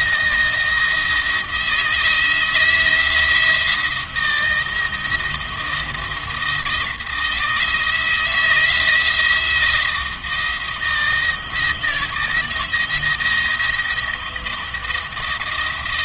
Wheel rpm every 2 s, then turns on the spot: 170, 170, 170, 170, 160, 160, 170, 170.
none